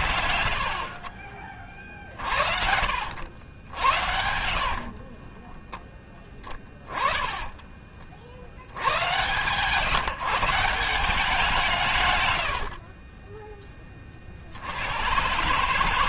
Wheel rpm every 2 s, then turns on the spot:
50, 60, 40, 20, 90, 170, 50, 90.
4-8 12-14